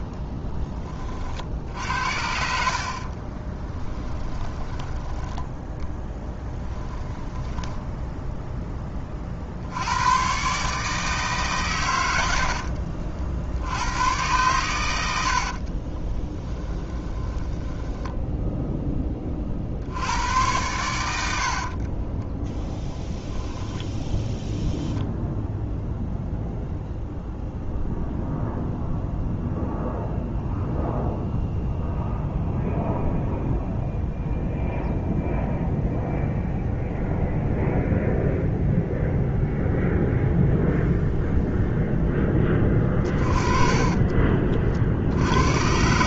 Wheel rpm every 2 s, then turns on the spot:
20, 50, 20, 20, 20, 150, 60, 100, 20, 10, 100, 10, 10, 0, 0, 0, 0, 0, 0, 0, 0, 20, 50.
6-8 14-18 42-44